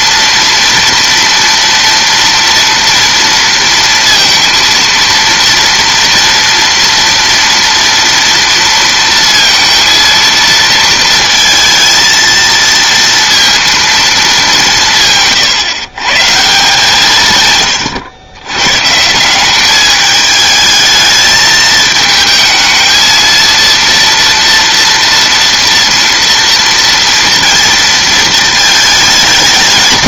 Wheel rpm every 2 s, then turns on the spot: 230, 230, 230, 230, 230, 230, 230, 180, 170, 110, 220, 220, 230, 240, 220.
none